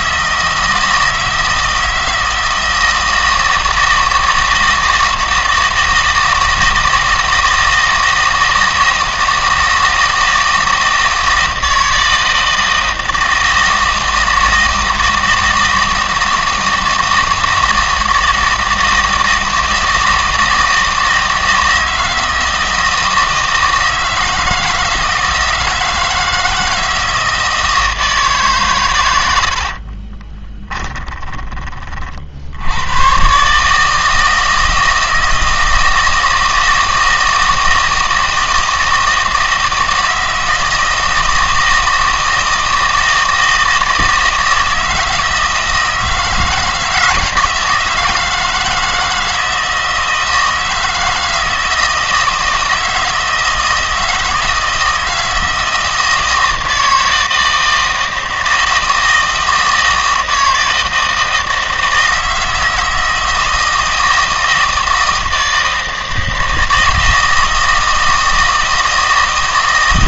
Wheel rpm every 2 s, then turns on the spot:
160, 160, 160, 160, 160, 160, 160, 160, 160, 170, 160, 160, 160, 160, 140, 20, 90, 160, 160, 160, 160, 160, 160, 160, 160, 160, 160, 160, 160, 160, 160, 160, 160, 160, 160.
30-32